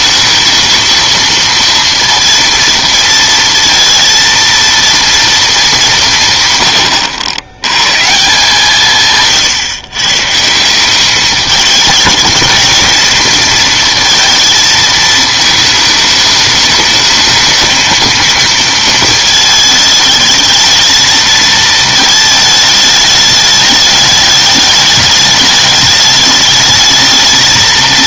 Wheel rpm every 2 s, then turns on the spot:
230, 230, 230, 120, 160, 190, 220, 220, 210, 230, 220, 210, 210, 210.
none